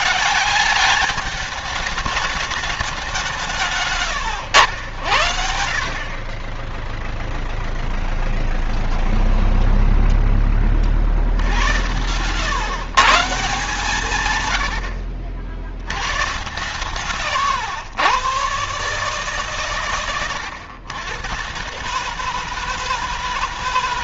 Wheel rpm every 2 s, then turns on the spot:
200, 200, 80, 0, 0, 50, 140, 80, 140, 140, 110, 160.
16-18